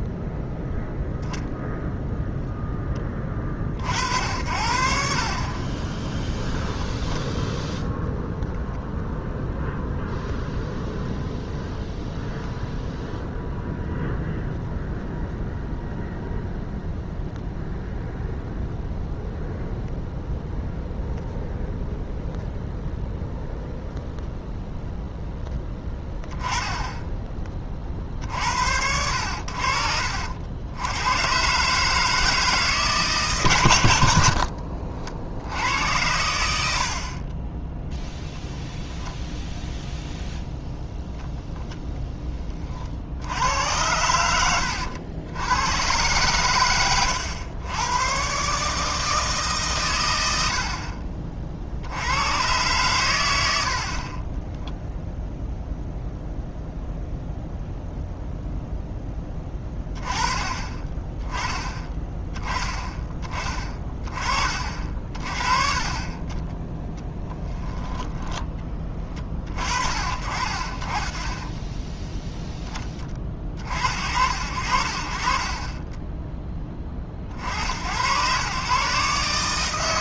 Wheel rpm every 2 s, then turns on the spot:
0, 10, 60, 10, 0, 0, 0, 0, 0, 0, 0, 0, 0, 10, 70, 90, 150, 50, 70, 0, 0, 30, 90, 100, 150, 60, 120, 0, 0, 0, 20, 10, 40, 10, 20, 40, 10, 60, 30, 140.
66-68